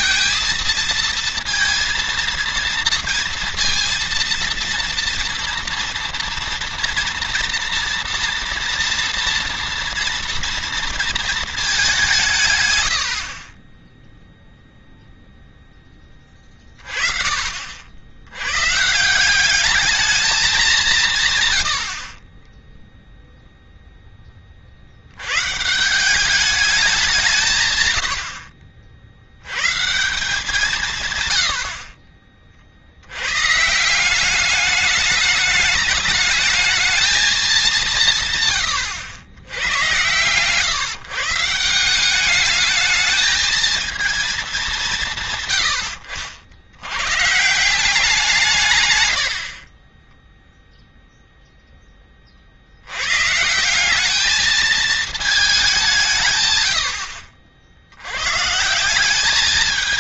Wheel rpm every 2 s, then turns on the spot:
220, 230, 230, 230, 230, 230, 140, 0, 20, 110, 200, 20, 30, 200, 80, 160, 40, 190, 220, 140, 130, 210, 200, 70, 160, 0, 40, 210, 140, 130.
none